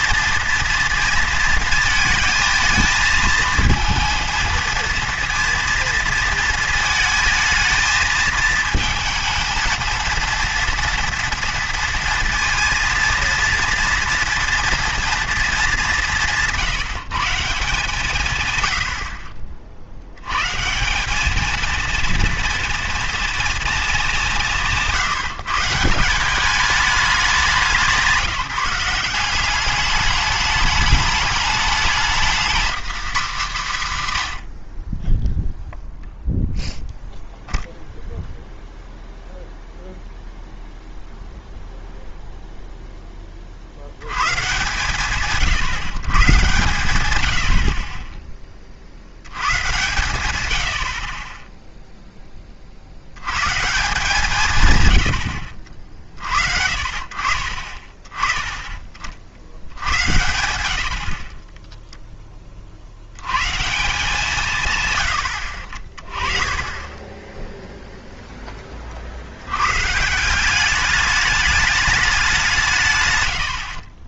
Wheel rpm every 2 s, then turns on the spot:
230, 220, 230, 220, 220, 230, 230, 240, 170, 90, 160, 230, 170, 210, 170, 210, 250, 60, 0, 0, 0, 0, 140, 110, 40, 80, 40, 150, 60, 30, 70, 40, 140, 20, 30, 200, 160.
none